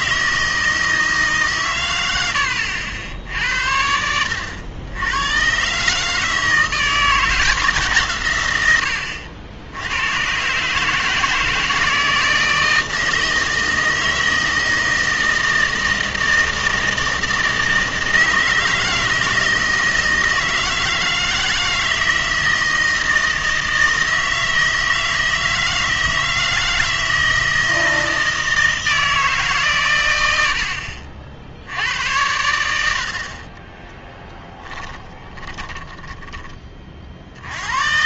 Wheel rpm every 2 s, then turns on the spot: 160, 80, 80, 170, 100, 140, 160, 160, 160, 160, 160, 170, 160, 160, 160, 70, 80, 10, 30.
34-36